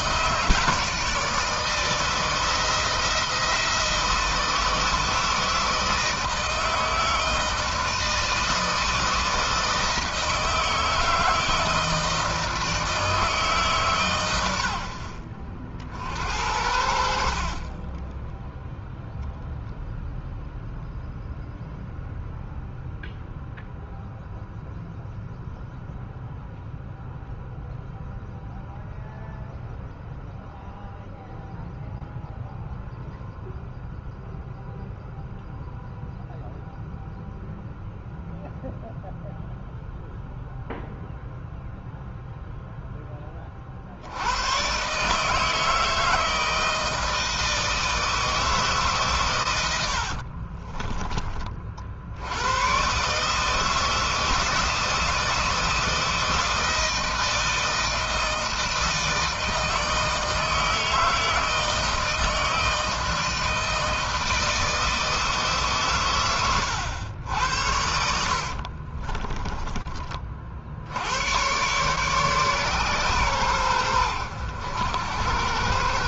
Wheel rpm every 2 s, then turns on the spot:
160, 160, 160, 160, 160, 160, 160, 80, 60, 0, 0, 0, 0, 0, 0, 0, 0, 0, 0, 0, 0, 10, 140, 160, 140, 30, 130, 160, 160, 160, 160, 160, 160, 90, 40, 80, 130, 80.
16-18 50-52 68-70